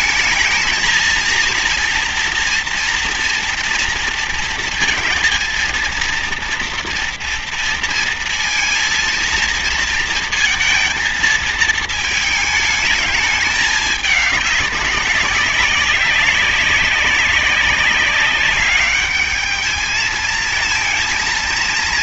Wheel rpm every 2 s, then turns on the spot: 230, 240, 230, 230, 230, 230, 220, 200, 200, 200, 220.
none